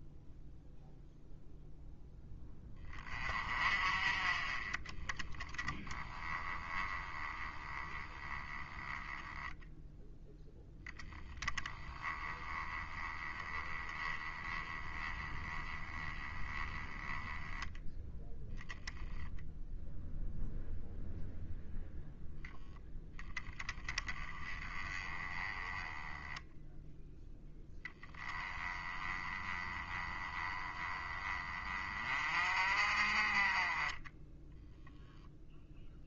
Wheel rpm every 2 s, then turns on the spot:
0, 20, 20, 10, 10, 10, 10, 10, 10, 10, 0, 0, 20, 0, 20, 20, 40, 0.
none